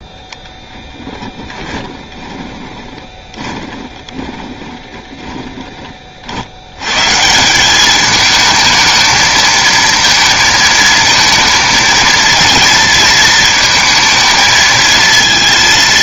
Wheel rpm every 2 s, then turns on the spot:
10, 20, 20, 90, 220, 230, 230, 220.
2-6